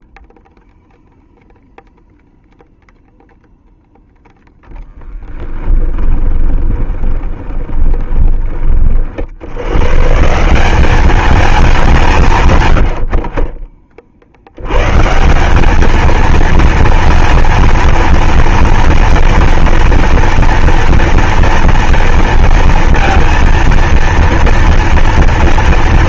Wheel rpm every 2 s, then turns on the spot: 0, 0, 0, 10, 20, 140, 170, 40, 220, 230, 230, 230, 230.
6-10